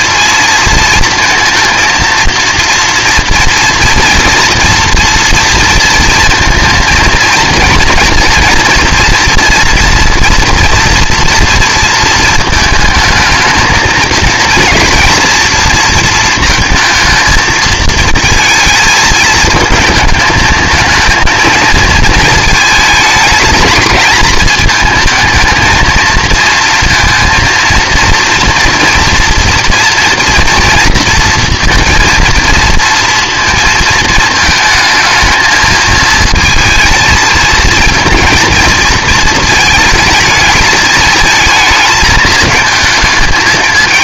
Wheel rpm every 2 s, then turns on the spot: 230, 230, 230, 230, 230, 230, 220, 230, 230, 220, 220, 220, 220, 230, 240, 230, 230, 220, 220, 230, 220, 220.
none